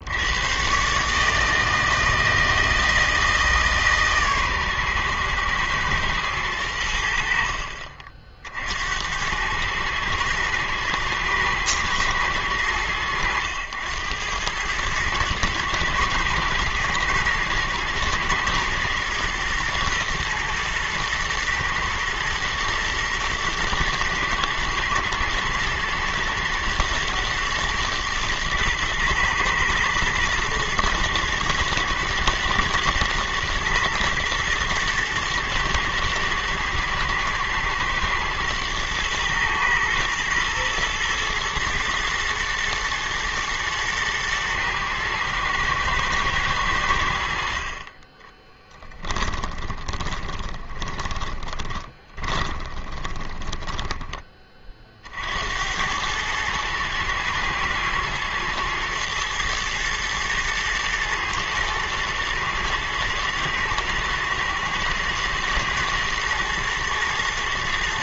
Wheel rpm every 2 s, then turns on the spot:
150, 160, 120, 70, 80, 110, 100, 110, 110, 120, 110, 110, 120, 120, 120, 110, 110, 110, 110, 110, 110, 110, 110, 70, 20, 20, 20, 60, 110, 110, 110, 110, 110, 110.
48-54